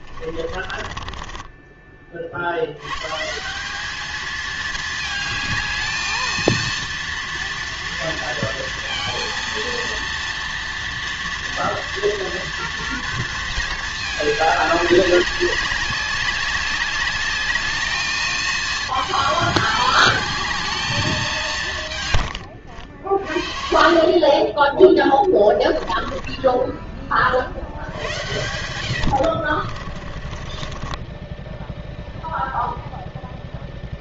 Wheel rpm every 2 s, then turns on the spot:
20, 70, 220, 230, 230, 230, 230, 200, 200, 220, 220, 90, 20, 20, 90, 30, 0.
0-2 22-24 26-32